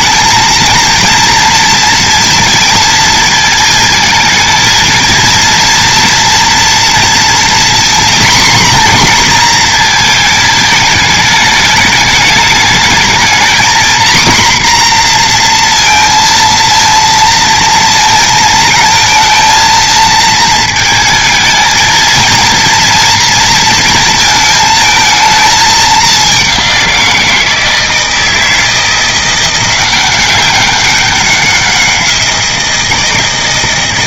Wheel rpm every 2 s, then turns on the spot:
230, 230, 220, 240, 240, 220, 220, 250, 230, 220, 220, 230, 220, 190, 170, 190, 170.
none